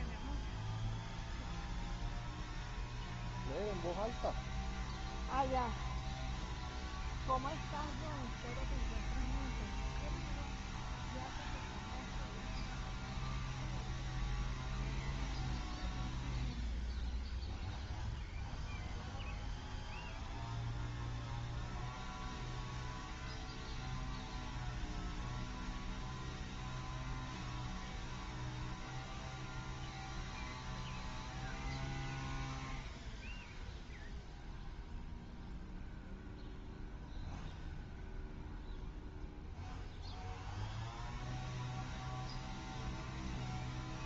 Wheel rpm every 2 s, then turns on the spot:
0, 0, 0, 0, 0, 0, 0, 0, 0, 0, 0, 0, 0, 0, 0, 0, 0, 0, 0, 0, 0, 0.
none